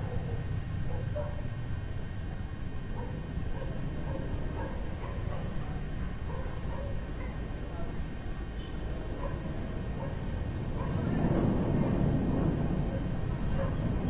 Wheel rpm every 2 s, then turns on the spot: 0, 0, 0, 0, 0, 0, 0.
none